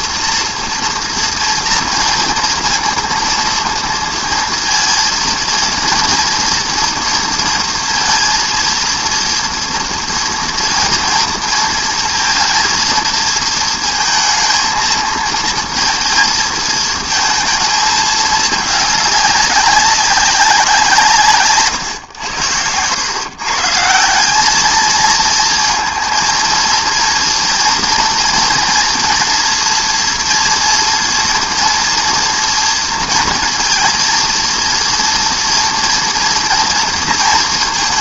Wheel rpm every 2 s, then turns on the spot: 240, 230, 230, 230, 230, 230, 220, 220, 230, 210, 190, 100, 210, 230, 240, 240, 240, 230, 230.
none